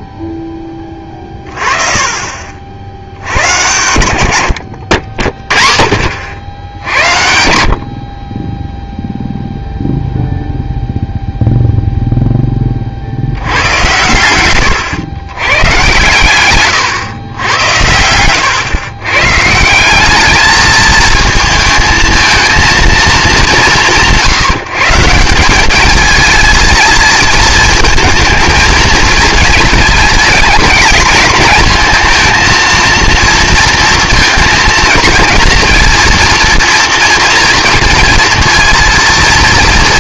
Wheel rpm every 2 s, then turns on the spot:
20, 50, 80, 80, 10, 0, 30, 110, 130, 120, 220, 230, 160, 220, 220, 210, 230, 230, 230, 230.
16-18